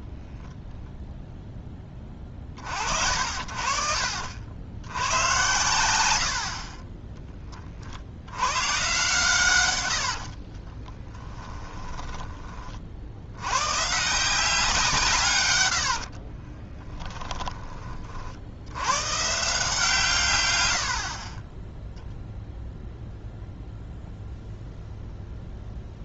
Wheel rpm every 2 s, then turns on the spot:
0, 50, 80, 30, 120, 30, 40, 180, 20, 80, 100, 0, 0.
10-12 16-18 20-22